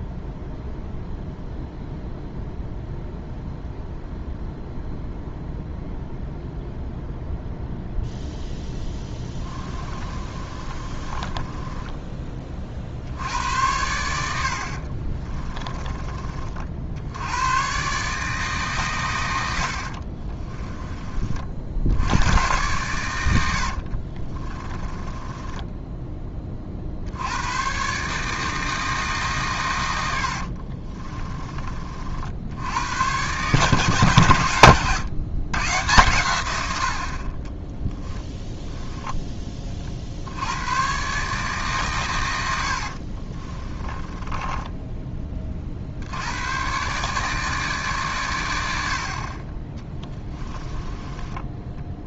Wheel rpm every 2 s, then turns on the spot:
0, 0, 0, 0, 10, 30, 30, 50, 60, 130, 20, 110, 20, 50, 160, 40, 80, 120, 80, 10, 100, 70, 20, 120, 70, 20.
8-12 14-16 24-26 30-32 44-46 50-52